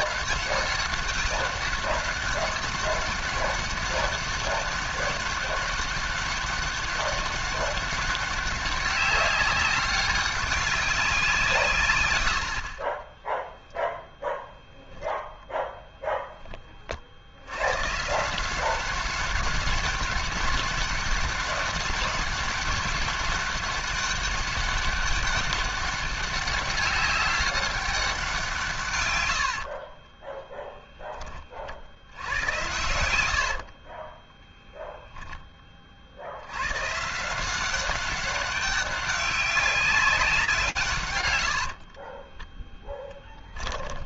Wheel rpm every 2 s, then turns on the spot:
200, 200, 200, 200, 200, 100, 10, 0, 150, 200, 200, 200, 200, 190, 40, 70, 30, 20, 190, 190, 50, 20.
28-30 32-34 40-44